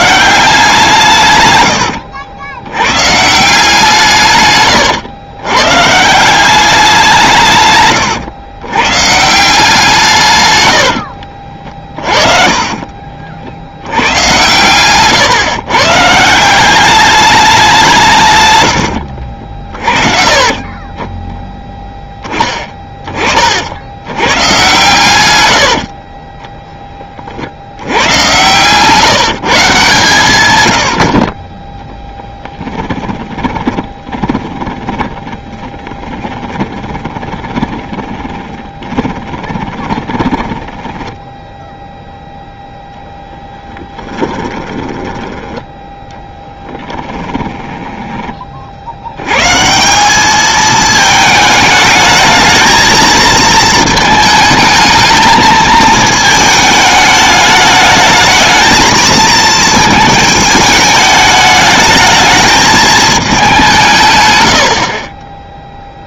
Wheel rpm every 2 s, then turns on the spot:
180, 110, 120, 190, 120, 90, 40, 120, 180, 90, 20, 20, 130, 20, 130, 100, 10, 10, 10, 30, 10, 0, 20, 10, 60, 220, 220, 220, 210, 220, 220, 220, 100.
4-6 10-14 20-22 32-42 44-48